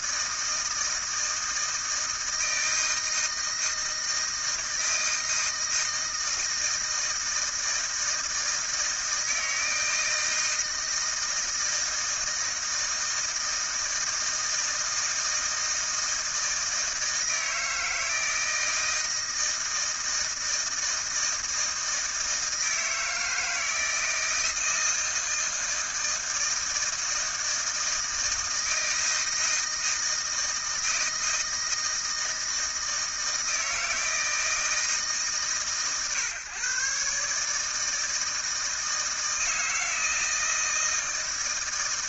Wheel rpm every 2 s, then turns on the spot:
160, 160, 160, 160, 160, 160, 160, 160, 160, 160, 160, 160, 160, 160, 160, 160, 160, 160, 130, 160, 160.
none